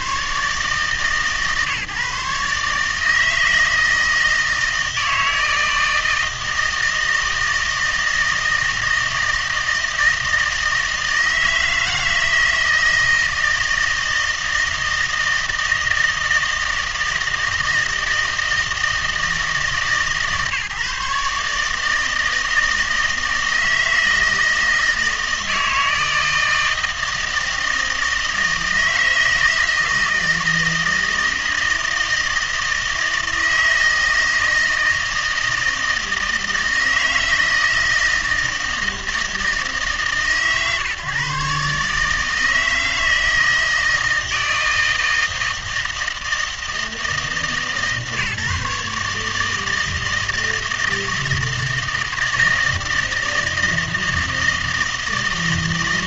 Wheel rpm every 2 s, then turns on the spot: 150, 150, 160, 160, 160, 160, 160, 160, 160, 160, 150, 160, 160, 160, 160, 160, 160, 160, 160, 160, 140, 160, 160, 160, 140, 160, 160, 160.
none